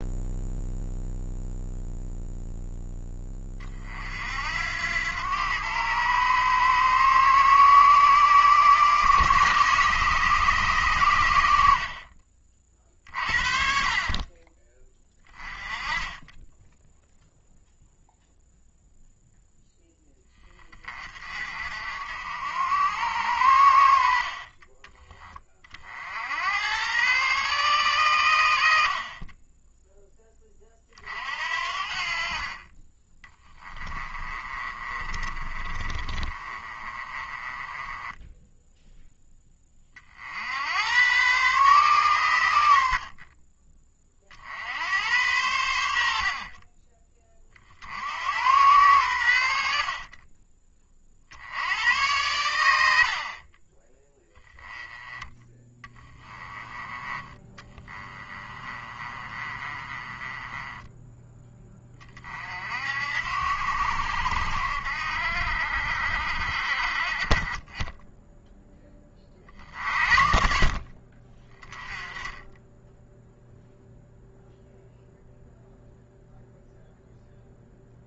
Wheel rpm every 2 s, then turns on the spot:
0, 10, 90, 110, 120, 110, 40, 20, 0, 0, 40, 80, 30, 110, 50, 40, 30, 30, 30, 10, 100, 60, 90, 30, 100, 30, 90, 10, 10, 30, 20, 60, 70, 40, 20, 50, 10, 0, 0.
28-30 34-38 46-48 58-60